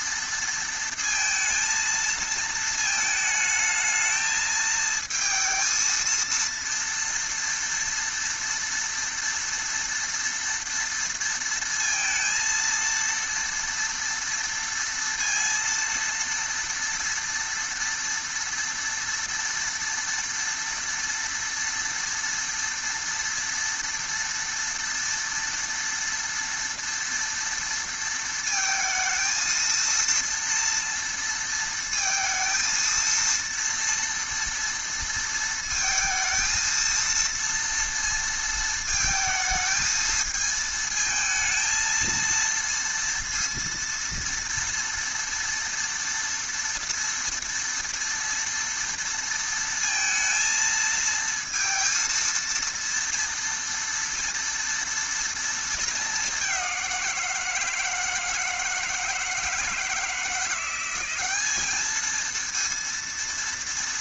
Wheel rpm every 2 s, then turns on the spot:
230, 220, 220, 230, 230, 230, 230, 240, 230, 230, 230, 230, 230, 230, 230, 230, 230, 230, 230, 230, 220, 230, 230, 230, 230, 230, 230, 230, 200, 160, 170, 230.
none